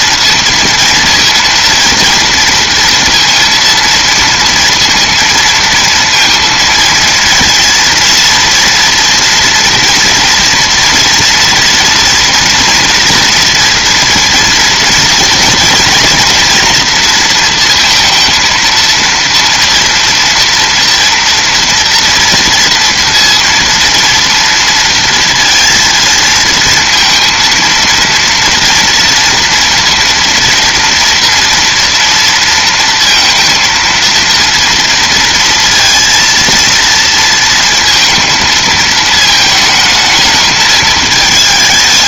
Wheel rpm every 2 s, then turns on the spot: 230, 230, 230, 230, 230, 230, 230, 230, 230, 230, 230, 230, 230, 230, 240, 230, 230, 230, 230, 220, 220.
none